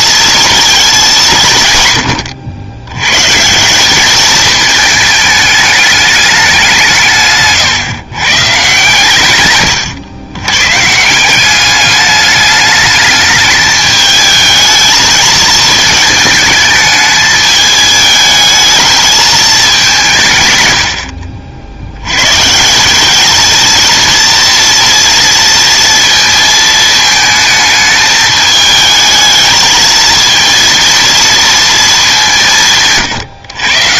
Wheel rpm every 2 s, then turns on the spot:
220, 100, 220, 180, 140, 120, 210, 220, 210, 220, 90, 170, 230, 220, 220, 230, 170.
none